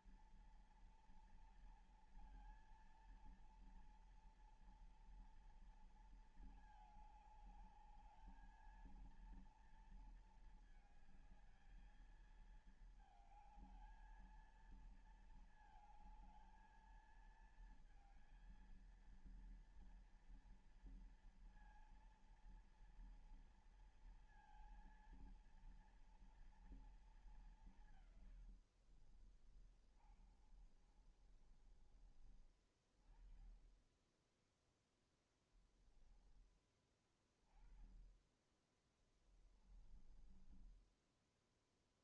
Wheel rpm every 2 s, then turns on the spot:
240, 230, 230, 210, 230, 220, 220, 230, 220, 230, 230, 230, 230, 220, 60, 30, 30, 10, 20, 20, 10.
28-32 38-42